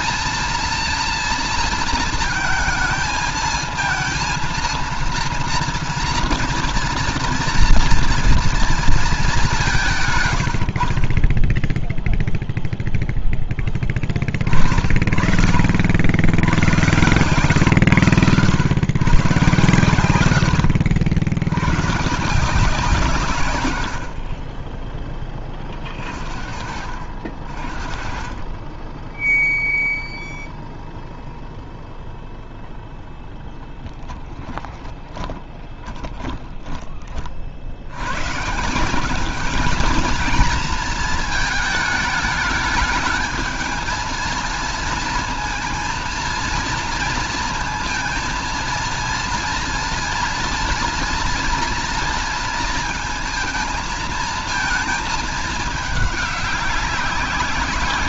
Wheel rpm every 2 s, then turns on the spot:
230, 220, 230, 230, 230, 100, 0, 30, 100, 120, 70, 160, 40, 50, 20, 0, 0, 20, 20, 140, 220, 210, 230, 230, 230, 230, 230, 220, 200.
34-38